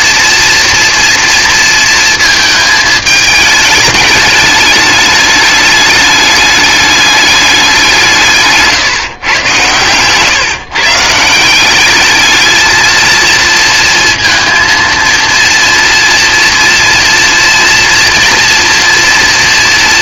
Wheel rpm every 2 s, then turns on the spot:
240, 220, 210, 210, 150, 140, 220, 230, 240, 230.
none